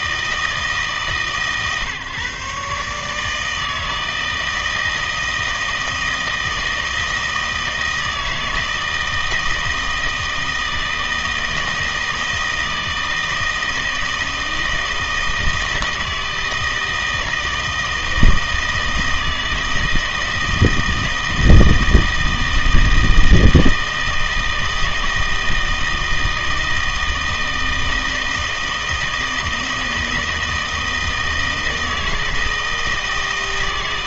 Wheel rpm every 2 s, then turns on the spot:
160, 140, 160, 160, 160, 160, 160, 160, 160, 160, 160, 160, 160, 160, 160, 160, 160.
none